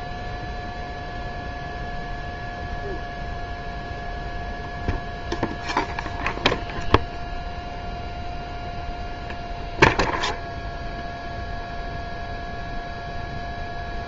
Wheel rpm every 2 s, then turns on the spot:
0, 0, 0, 0, 0, 0, 0.
none